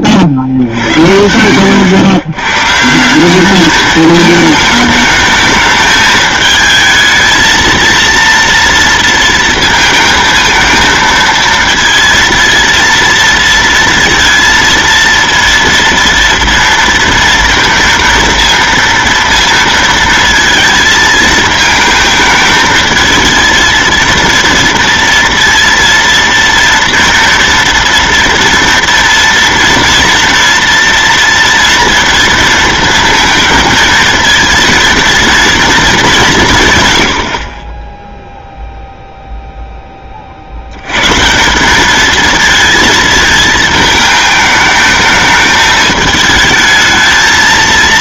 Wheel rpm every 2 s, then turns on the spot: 70, 130, 220, 220, 230, 220, 230, 230, 230, 230, 230, 220, 230, 230, 230, 230, 230, 230, 150, 0, 50, 230, 220, 220.
none